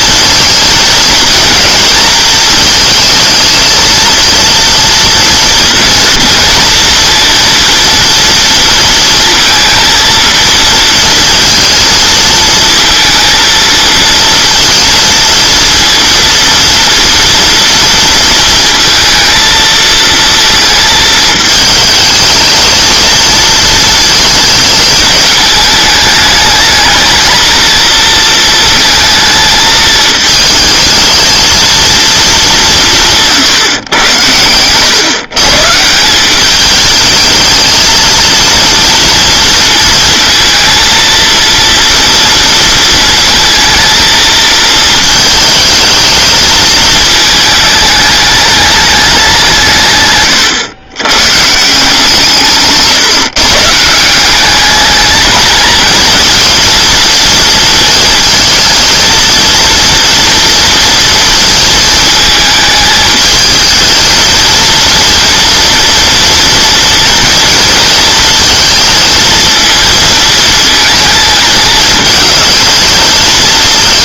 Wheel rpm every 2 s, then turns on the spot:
220, 230, 230, 230, 230, 230, 230, 230, 230, 230, 230, 220, 220, 220, 230, 220, 190, 110, 200, 230, 230, 230, 220, 220, 210, 120, 150, 200, 230, 230, 230, 220, 230, 240, 230, 220, 220.
none